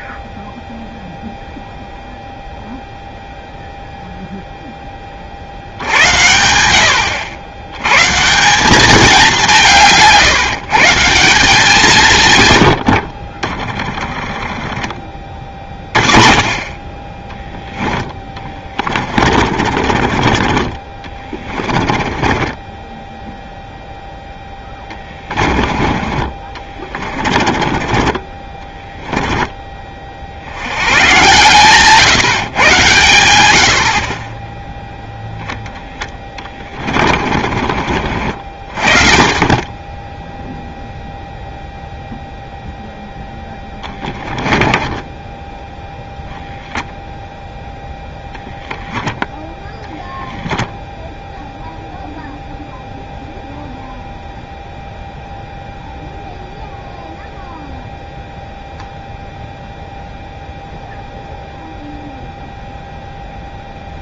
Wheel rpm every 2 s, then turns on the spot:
0, 0, 10, 80, 190, 160, 100, 10, 30, 20, 30, 10, 10, 30, 20, 90, 120, 0, 20, 40, 0, 0, 10, 0, 0, 0, 0, 0, 0, 0, 0, 0.
18-20 22-30 36-38 44-46